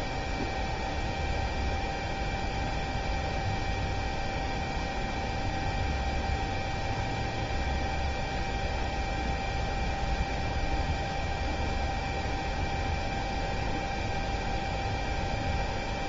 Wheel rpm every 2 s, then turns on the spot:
0, 0, 0, 0, 0, 0, 0, 0.
none